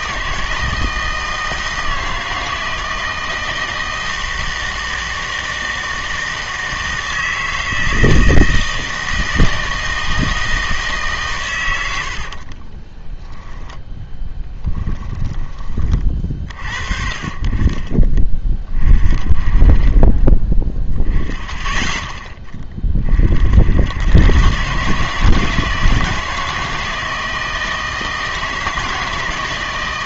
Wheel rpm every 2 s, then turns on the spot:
160, 160, 160, 160, 160, 160, 40, 10, 40, 30, 20, 20, 130, 160, 160.
12-16